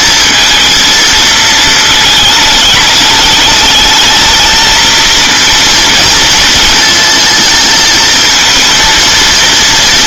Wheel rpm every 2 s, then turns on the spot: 230, 220, 220, 230, 230.
none